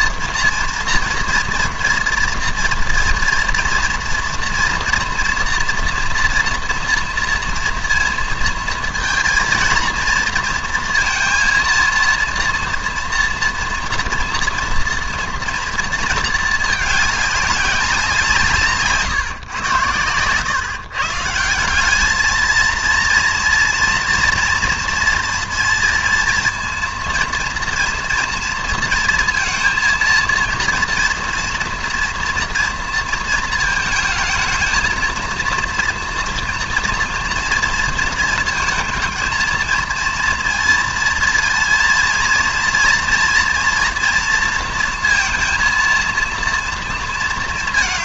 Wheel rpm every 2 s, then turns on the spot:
230, 230, 230, 230, 230, 230, 230, 230, 220, 160, 130, 230, 240, 230, 230, 230, 230, 220, 230, 220, 230, 230, 230, 230.
none